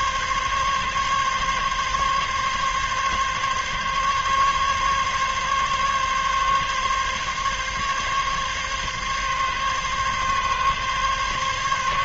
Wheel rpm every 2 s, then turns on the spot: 140, 140, 140, 140, 140, 140.
none